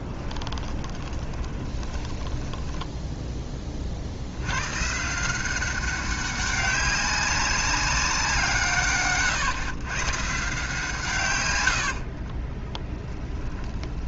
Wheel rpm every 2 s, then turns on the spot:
20, 10, 120, 200, 150, 150, 20.
0-2 12-14